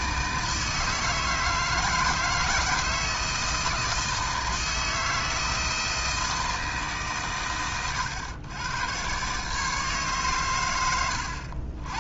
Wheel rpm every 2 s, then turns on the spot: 160, 160, 160, 150, 120, 100.
none